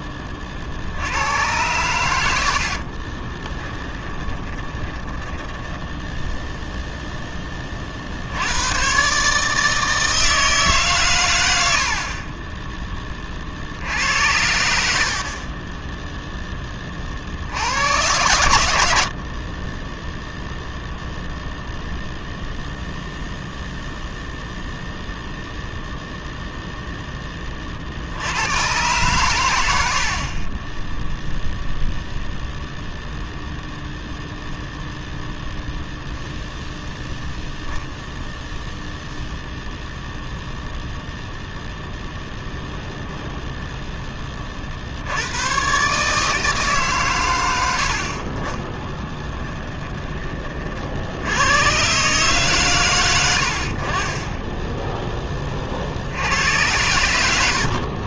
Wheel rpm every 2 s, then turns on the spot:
40, 50, 20, 0, 100, 150, 20, 70, 30, 80, 0, 0, 0, 0, 120, 20, 0, 0, 0, 0, 0, 0, 50, 150, 10, 50, 120, 10, 100.
2-6 48-50